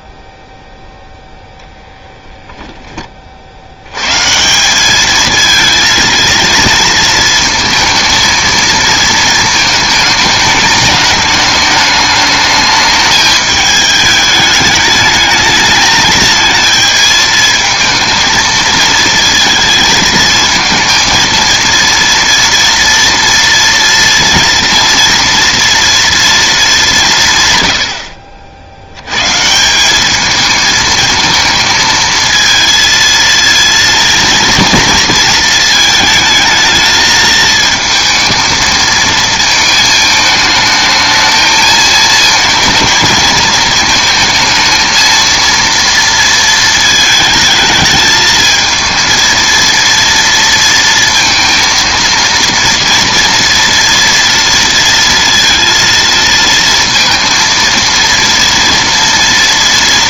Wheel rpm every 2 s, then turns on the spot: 0, 10, 180, 230, 230, 210, 210, 210, 220, 220, 220, 230, 230, 210, 70, 220, 220, 230, 220, 220, 220, 230, 230, 220, 220, 230, 230, 230, 230, 230.
none